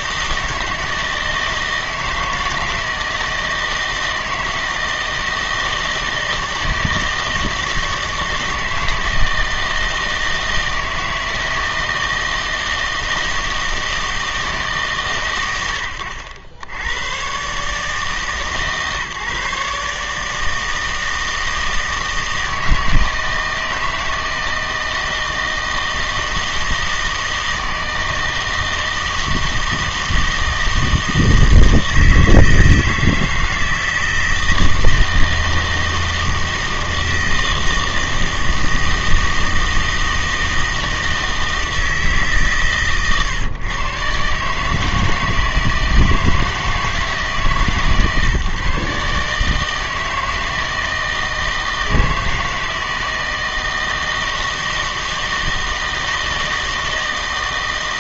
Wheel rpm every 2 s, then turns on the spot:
160, 160, 160, 160, 160, 160, 160, 140, 90, 150, 160, 160, 160, 160, 160, 160, 160, 160, 160, 160, 160, 140, 150, 160, 140, 160, 160, 160, 160.
none